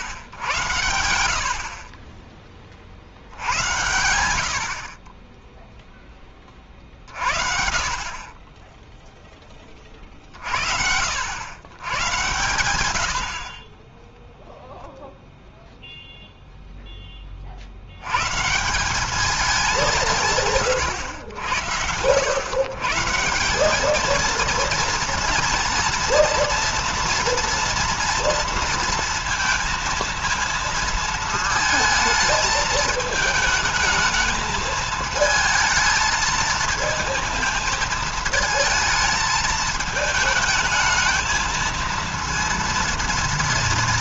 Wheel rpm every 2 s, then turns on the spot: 100, 40, 70, 40, 20, 60, 110, 0, 0, 160, 130, 120, 230, 230, 230, 230, 220, 220, 230, 220, 220, 230.
none